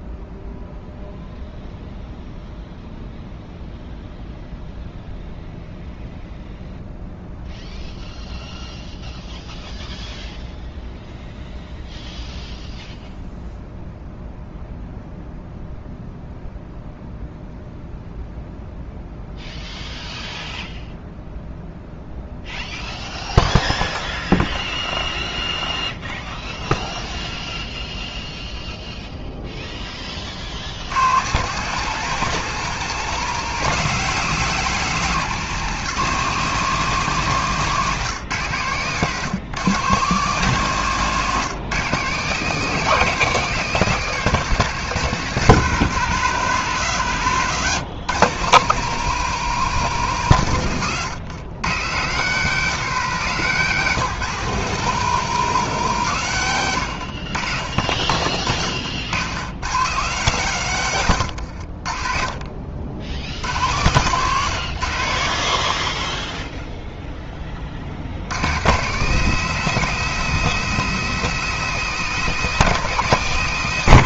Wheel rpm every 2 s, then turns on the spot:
0, 0, 0, 0, 0, 0, 0, 0, 0, 0, 0, 0, 0, 0, 0, 90, 180, 170, 170, 130, 160, 180, 170, 110, 170, 130, 170, 170, 100, 70, 110, 60, 80, 0, 140, 190, 180.
none